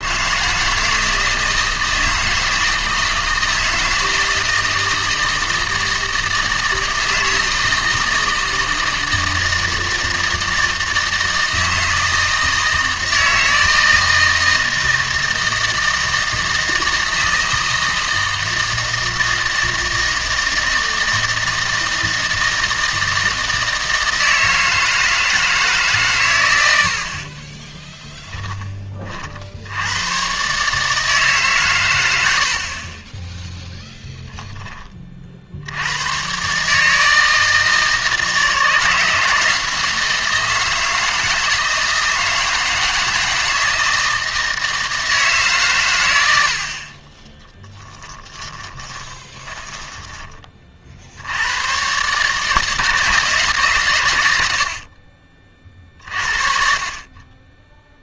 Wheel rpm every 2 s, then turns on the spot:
160, 160, 160, 160, 160, 160, 160, 160, 160, 160, 160, 160, 160, 80, 30, 150, 30, 20, 150, 170, 160, 160, 160, 40, 20, 50, 160, 60, 40.
48-50